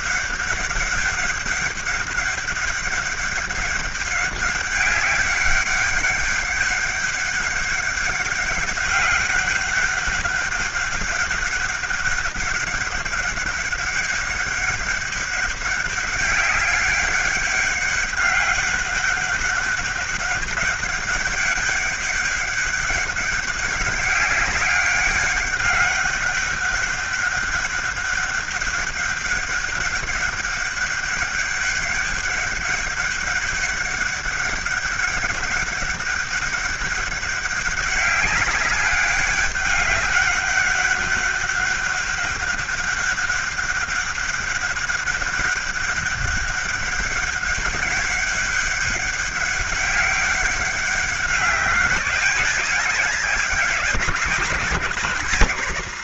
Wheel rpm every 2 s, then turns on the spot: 200, 200, 200, 200, 200, 200, 200, 200, 200, 200, 200, 200, 200, 190, 200, 200, 200, 200, 200, 200, 190, 200, 200, 200, 200, 200, 190, 160.
none